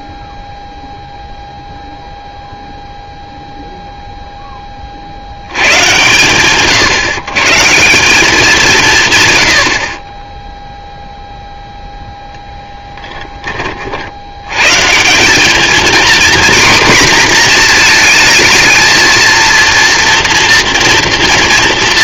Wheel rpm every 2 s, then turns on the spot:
0, 0, 60, 110, 150, 0, 10, 150, 240, 220, 230.
none